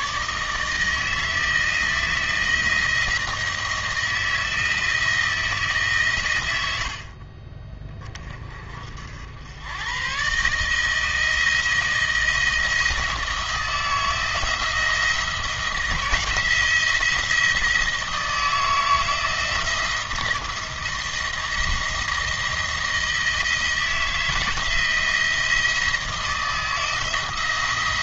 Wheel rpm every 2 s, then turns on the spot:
150, 170, 160, 80, 60, 150, 160, 160, 170, 160, 160, 160, 160, 160.
none